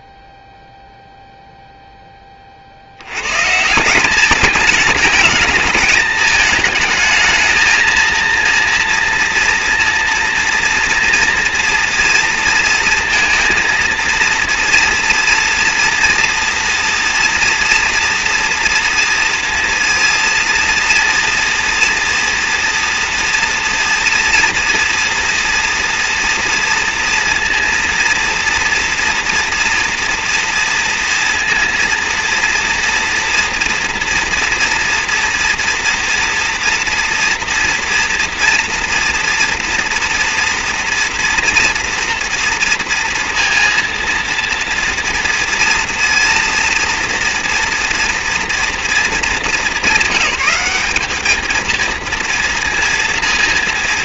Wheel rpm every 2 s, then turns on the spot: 0, 30, 210, 220, 230, 230, 230, 230, 230, 230, 240, 230, 230, 240, 240, 230, 230, 230, 230, 230, 230, 230, 230, 230, 240, 200, 230.
none